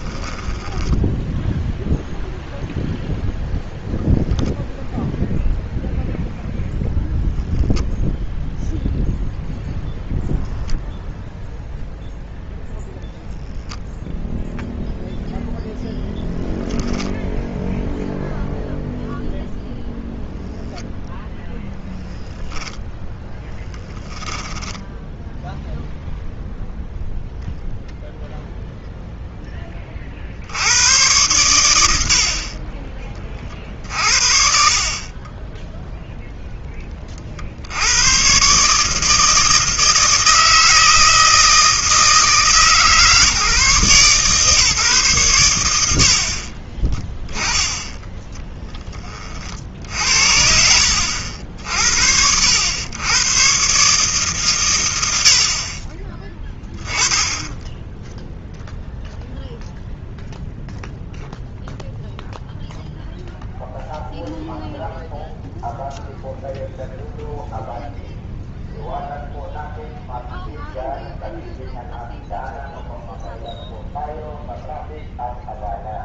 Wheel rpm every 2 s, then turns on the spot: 10, 0, 0, 0, 0, 0, 0, 0, 10, 0, 0, 0, 10, 0, 0, 80, 50, 70, 10, 140, 160, 150, 150, 20, 10, 70, 80, 120, 10, 0, 0, 0, 0, 0, 0, 0, 0, 0.
0-2 24-26 46-48